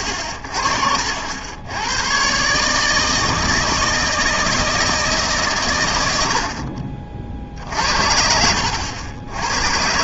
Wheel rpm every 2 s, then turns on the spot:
40, 140, 160, 50, 80.
none